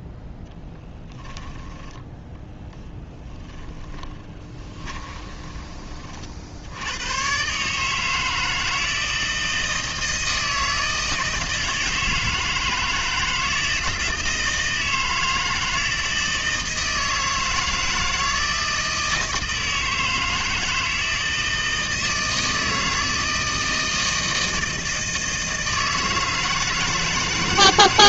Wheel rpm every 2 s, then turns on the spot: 10, 10, 20, 90, 160, 160, 160, 160, 160, 160, 160, 160, 160, 160.
0-6